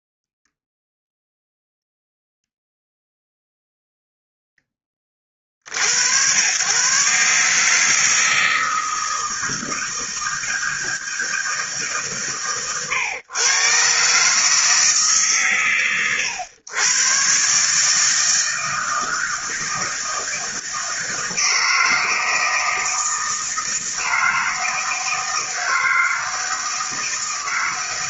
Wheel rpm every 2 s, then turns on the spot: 0, 0, 10, 110, 160, 160, 120, 150, 110, 160, 160, 160, 160, 160.
none